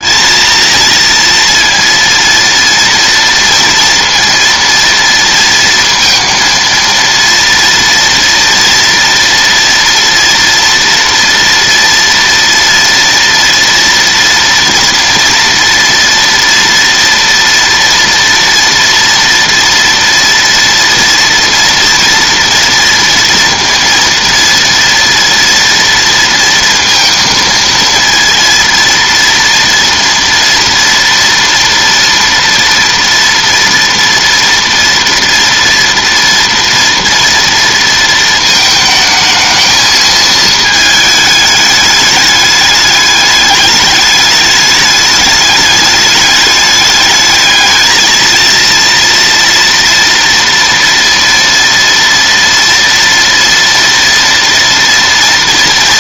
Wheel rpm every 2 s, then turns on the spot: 230, 230, 230, 230, 230, 230, 230, 230, 230, 230, 230, 230, 230, 230, 230, 230, 230, 240, 230, 220, 220, 210, 210, 210, 230, 230, 230, 230.
none